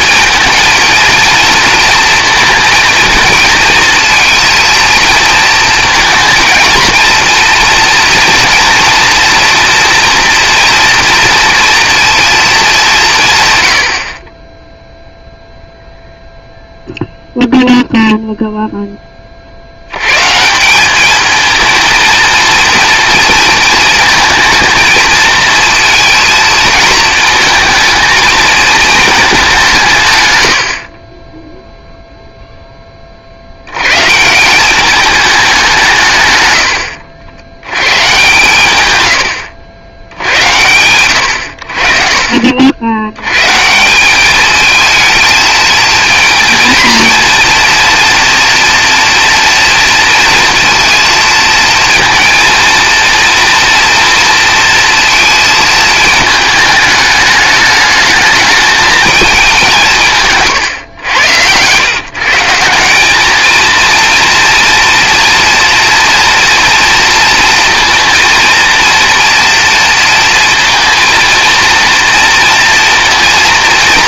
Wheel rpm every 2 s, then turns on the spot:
230, 230, 230, 220, 230, 230, 160, 0, 0, 10, 200, 230, 220, 220, 220, 50, 10, 190, 100, 120, 100, 60, 220, 230, 240, 230, 230, 230, 210, 210, 130, 170, 230, 230, 230, 230, 230.
60-62